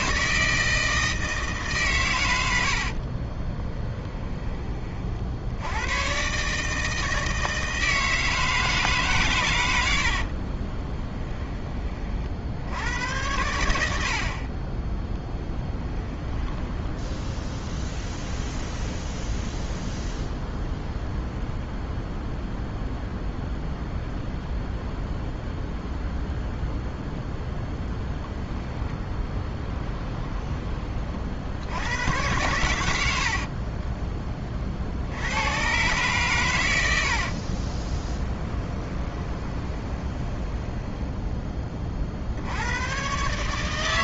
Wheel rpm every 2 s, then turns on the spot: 160, 60, 40, 160, 150, 20, 80, 10, 10, 0, 0, 0, 0, 0, 10, 30, 90, 50, 90, 20, 10, 120.
2-4 10-12 14-18 38-40